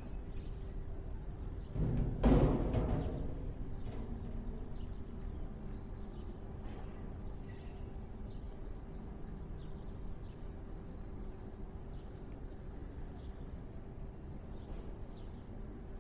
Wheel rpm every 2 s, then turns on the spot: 0, 0, 0, 0, 0, 0, 0, 0.
none